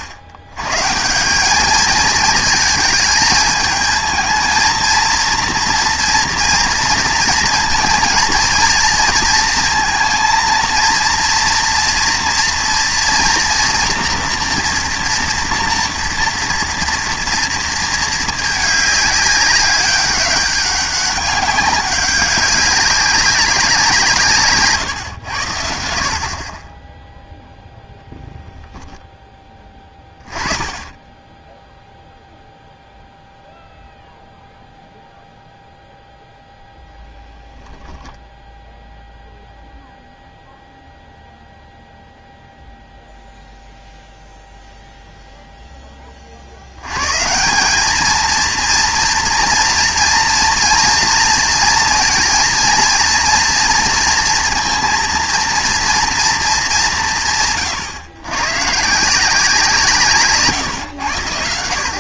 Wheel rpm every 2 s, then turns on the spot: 120, 220, 230, 230, 230, 230, 230, 230, 230, 210, 200, 190, 140, 20, 0, 10, 0, 0, 10, 0, 0, 0, 0, 100, 240, 240, 230, 240, 210, 140, 120.
none